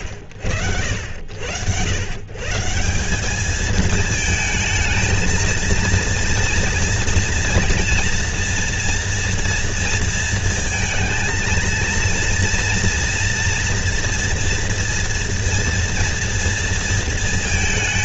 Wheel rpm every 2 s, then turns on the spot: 70, 150, 220, 230, 240, 230, 230, 240, 230.
none